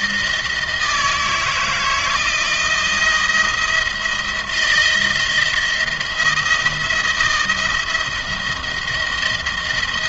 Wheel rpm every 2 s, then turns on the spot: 160, 160, 170, 170, 170.
none